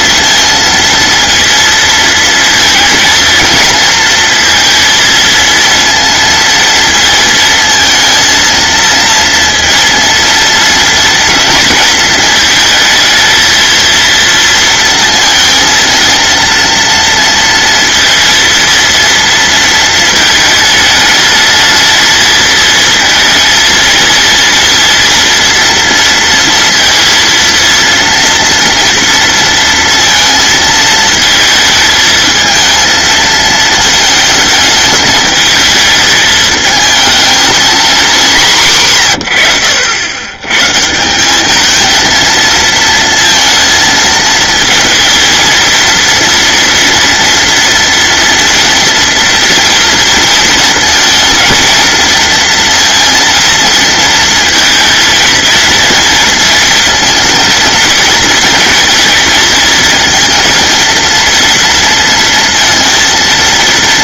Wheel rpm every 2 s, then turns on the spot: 230, 230, 230, 230, 230, 230, 230, 220, 230, 230, 230, 220, 230, 230, 230, 230, 220, 220, 220, 230, 90, 200, 230, 230, 230, 230, 220, 230, 230, 230, 230, 230.
none